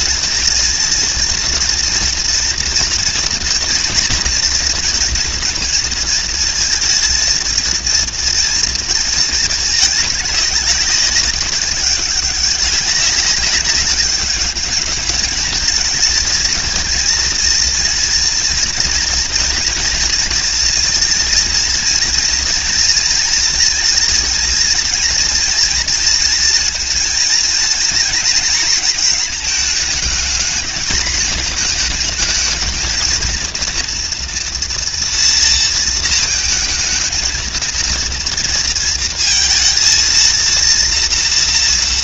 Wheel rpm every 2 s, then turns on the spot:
230, 230, 240, 230, 230, 190, 200, 210, 230, 230, 230, 230, 230, 220, 230, 220, 230, 240, 230, 230, 230.
none